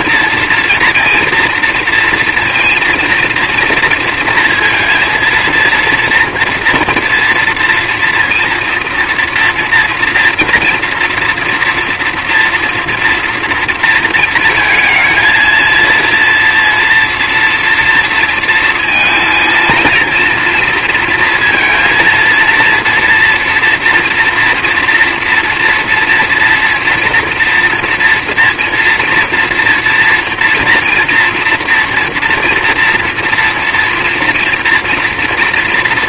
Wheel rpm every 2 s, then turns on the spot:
230, 230, 230, 230, 230, 230, 230, 230, 240, 230, 230, 230, 230, 230, 230, 230, 240, 230.
none